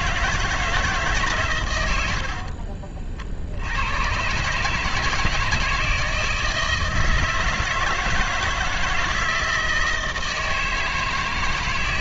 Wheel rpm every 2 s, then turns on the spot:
160, 50, 140, 160, 160, 160.
2-4